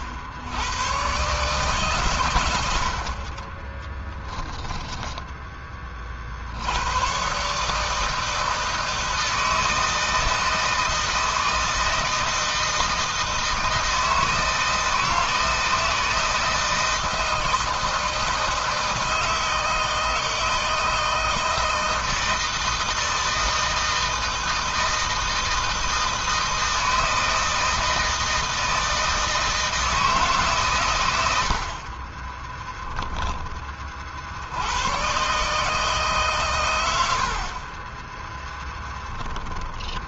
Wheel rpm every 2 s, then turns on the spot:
90, 100, 10, 70, 160, 160, 160, 160, 160, 160, 160, 160, 160, 160, 160, 150, 20, 70, 120, 10.
4-6 32-34 38-40